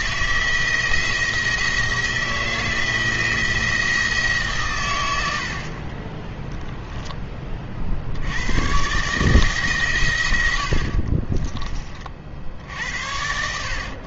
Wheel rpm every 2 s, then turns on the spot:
170, 170, 130, 0, 110, 80, 60.
10-12